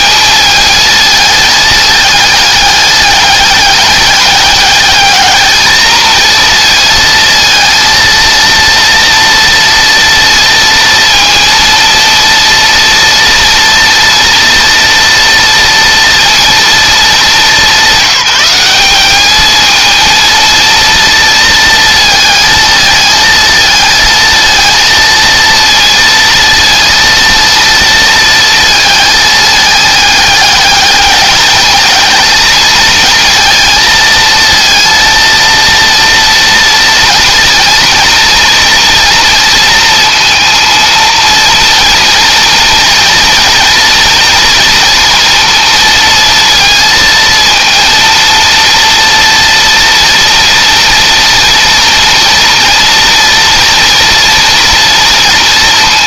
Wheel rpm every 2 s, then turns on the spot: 220, 210, 210, 230, 230, 230, 230, 230, 220, 210, 230, 220, 230, 230, 220, 210, 220, 230, 230, 230, 230, 230, 230, 230, 230, 230, 240, 230.
none